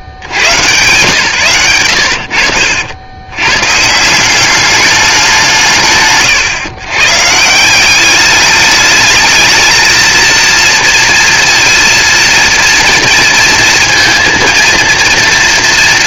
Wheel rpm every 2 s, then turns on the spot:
90, 70, 200, 130, 210, 230, 230, 220.
none